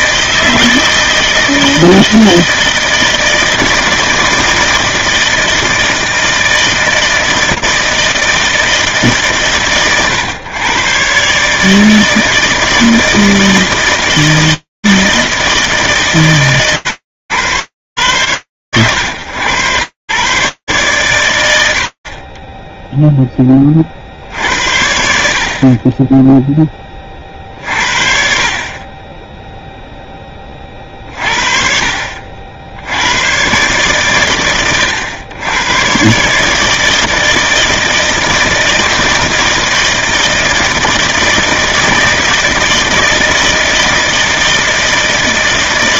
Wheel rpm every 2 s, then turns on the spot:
160, 160, 160, 160, 120, 150, 160, 150, 100, 110, 100, 30, 40, 40, 10, 60, 120, 120, 160, 160, 160, 160, 150.
none